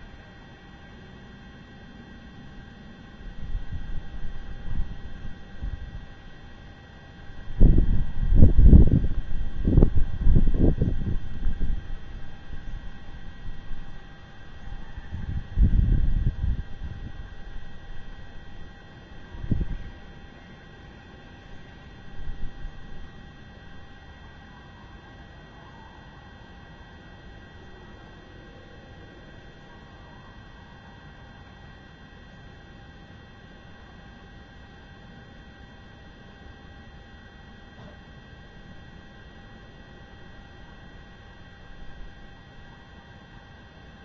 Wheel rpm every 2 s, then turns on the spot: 0, 0, 0, 0, 0, 0, 0, 0, 0, 0, 0, 0, 0, 0, 0, 0, 0, 0, 0, 0, 0, 0.
none